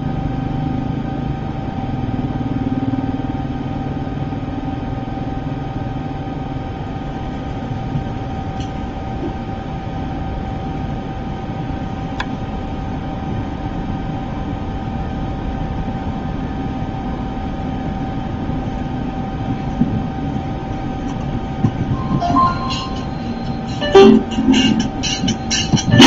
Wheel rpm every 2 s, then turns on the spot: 0, 0, 0, 0, 0, 0, 0, 0, 0, 0, 0, 0, 0.
none